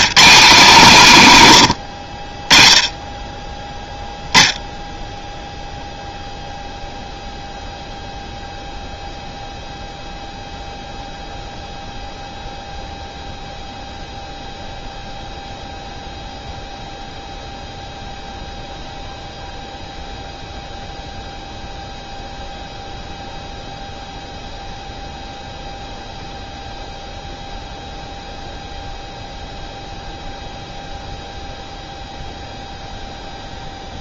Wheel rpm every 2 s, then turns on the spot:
200, 30, 0, 0, 0, 0, 0, 0, 0, 0, 0, 0, 0, 0, 0, 0, 0.
none